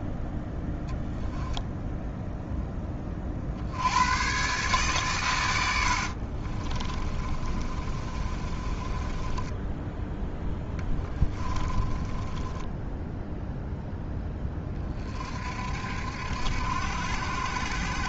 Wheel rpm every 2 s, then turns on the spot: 0, 0, 130, 40, 30, 10, 10, 20, 70.
6-10 12-14